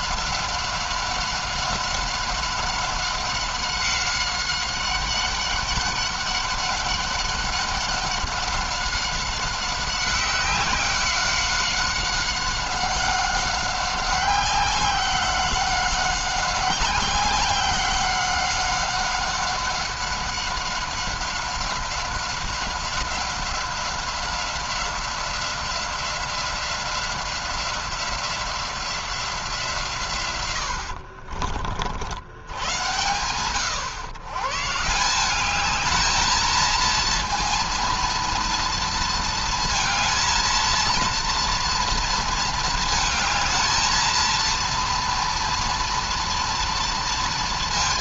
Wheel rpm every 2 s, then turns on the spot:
190, 200, 190, 200, 190, 190, 190, 190, 190, 190, 190, 190, 190, 180, 180, 110, 100, 140, 220, 230, 230, 230, 230, 230.
none